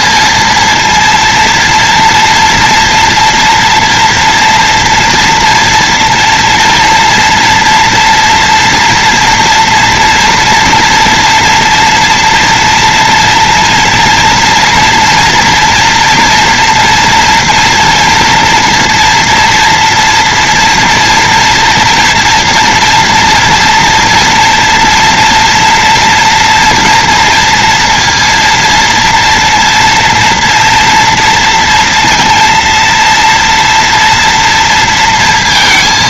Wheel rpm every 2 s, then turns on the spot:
230, 230, 230, 230, 240, 230, 230, 230, 240, 230, 230, 230, 230, 240, 230, 230, 230, 230.
none